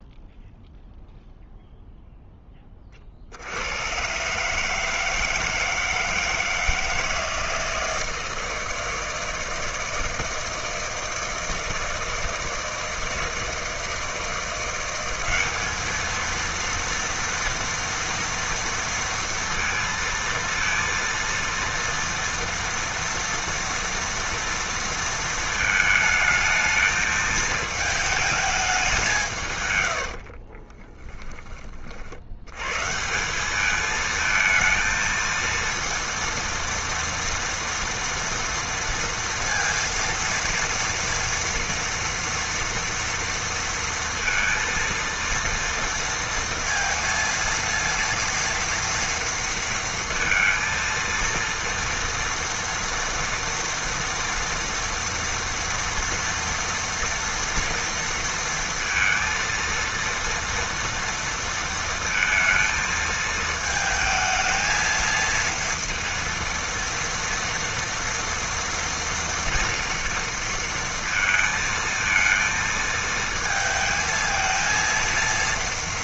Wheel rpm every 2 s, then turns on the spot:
0, 20, 150, 160, 160, 160, 160, 170, 230, 230, 230, 230, 230, 220, 210, 30, 110, 230, 230, 230, 230, 230, 230, 230, 230, 230, 230, 230, 230, 230, 230, 220, 220, 230, 240, 230, 230, 230.
30-32